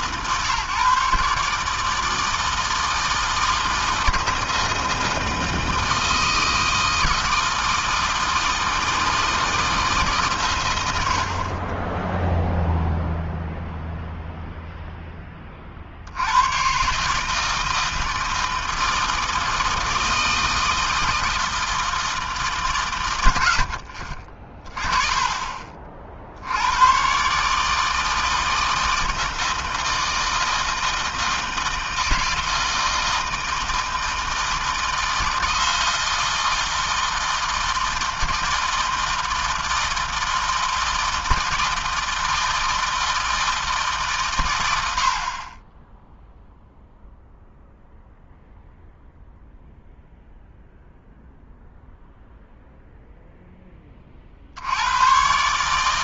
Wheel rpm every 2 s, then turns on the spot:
140, 160, 160, 160, 160, 70, 0, 10, 150, 160, 160, 110, 20, 130, 160, 160, 160, 160, 160, 160, 160, 160, 60, 0, 0, 0, 0, 110.
none